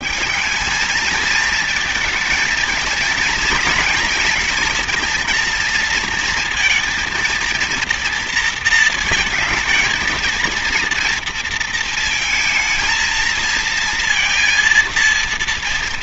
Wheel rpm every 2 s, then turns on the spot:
210, 230, 230, 230, 230, 240, 230, 230.
none